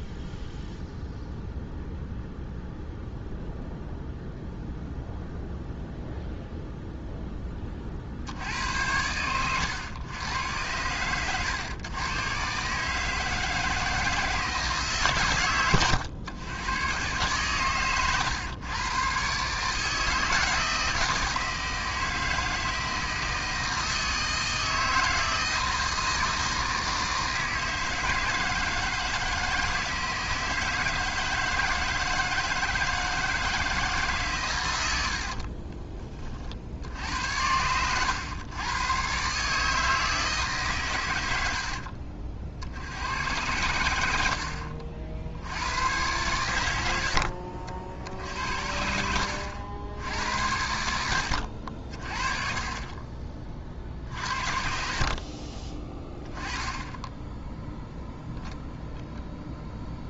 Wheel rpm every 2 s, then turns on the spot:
0, 0, 0, 0, 70, 100, 140, 150, 110, 120, 160, 160, 160, 160, 160, 160, 160, 110, 50, 110, 140, 70, 60, 90, 70, 80, 30, 60, 10, 0.
none